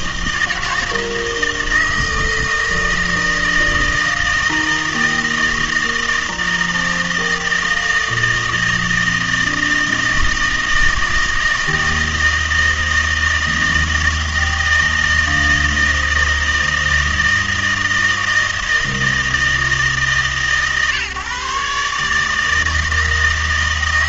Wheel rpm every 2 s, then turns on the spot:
160, 160, 160, 160, 160, 160, 160, 160, 160, 160, 140, 160.
none